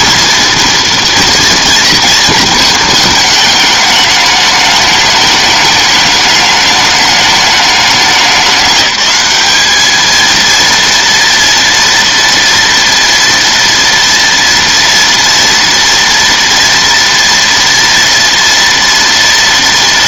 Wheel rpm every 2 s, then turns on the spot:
240, 220, 210, 210, 200, 230, 230, 230, 230, 230.
none